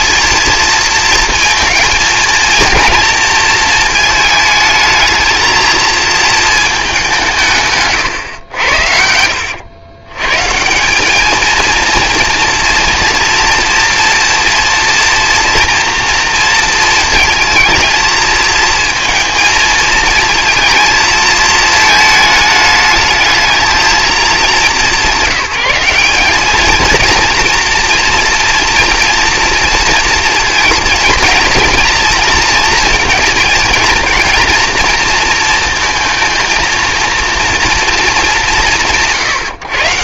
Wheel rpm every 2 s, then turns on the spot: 230, 230, 220, 210, 80, 180, 230, 240, 220, 220, 230, 210, 190, 230, 230, 230, 230, 230, 230, 120.
none